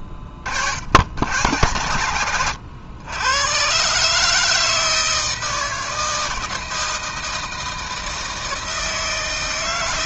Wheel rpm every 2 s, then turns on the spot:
50, 90, 160, 160, 160.
none